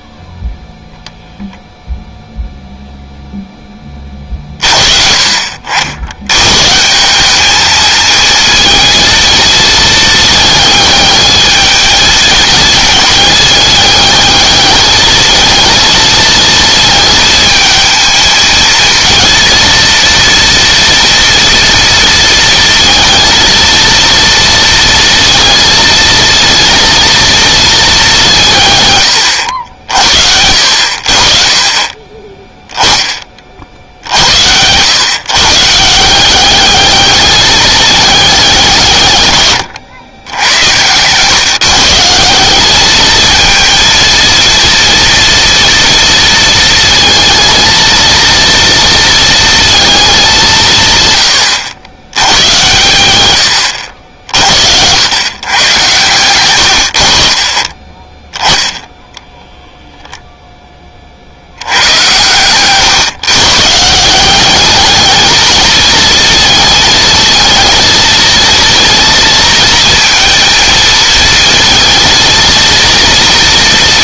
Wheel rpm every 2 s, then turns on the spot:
0, 0, 50, 150, 230, 220, 220, 220, 220, 230, 230, 230, 230, 230, 140, 70, 10, 120, 210, 160, 100, 210, 230, 230, 230, 150, 110, 80, 90, 0, 20, 120, 200, 220, 230, 230, 230.
none